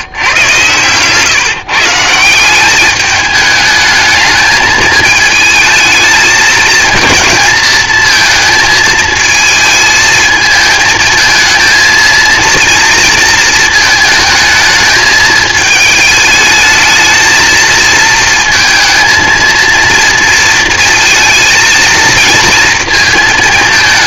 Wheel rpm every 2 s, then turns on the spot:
130, 200, 220, 230, 220, 220, 230, 220, 220, 230, 230, 230.
none